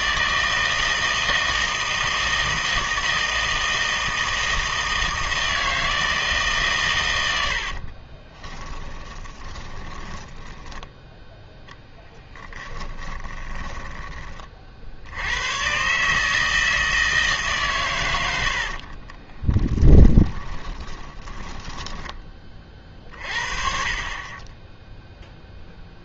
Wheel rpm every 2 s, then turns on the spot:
160, 160, 160, 130, 20, 10, 20, 50, 160, 60, 20, 30, 10.
8-14 18-22